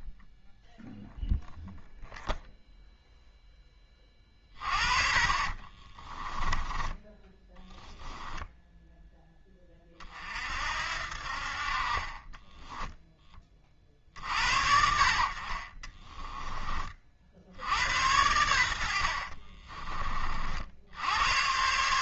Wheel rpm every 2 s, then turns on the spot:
0, 0, 30, 20, 10, 60, 10, 50, 30, 70, 80.
4-8